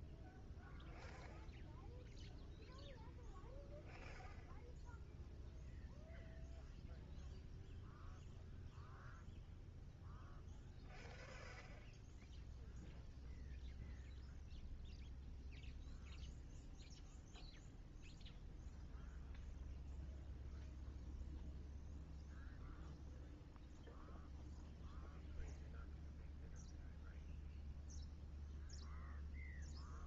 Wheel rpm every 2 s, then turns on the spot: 0, 0, 0, 0, 0, 0, 0, 0, 0, 0, 0, 0, 0, 0, 0.
none